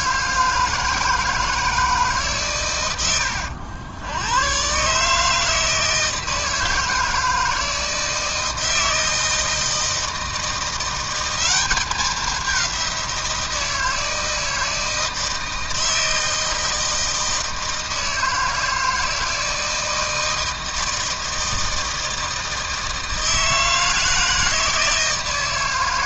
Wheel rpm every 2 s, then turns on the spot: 160, 110, 140, 160, 160, 180, 180, 160, 160, 160, 160, 160, 160.
none